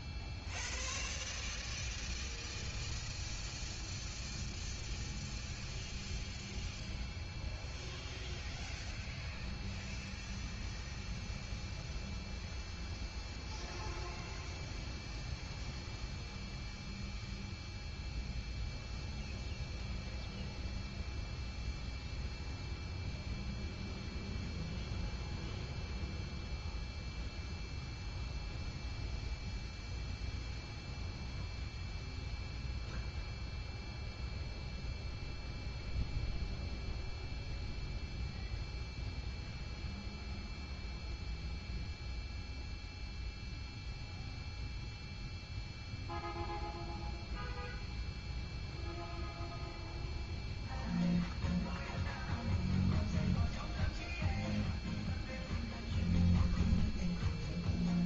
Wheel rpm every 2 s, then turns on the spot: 0, 0, 0, 0, 0, 0, 0, 0, 0, 0, 0, 0, 0, 0, 0, 0, 0, 0, 0, 0, 0, 0, 0, 0, 0, 0, 0, 0, 0.
none